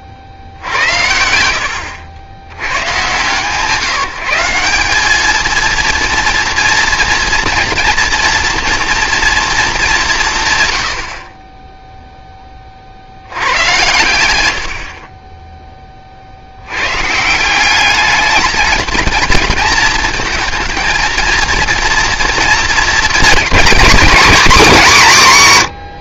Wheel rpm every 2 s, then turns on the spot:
70, 120, 180, 230, 240, 120, 10, 110, 70, 210, 230, 230, 260.
none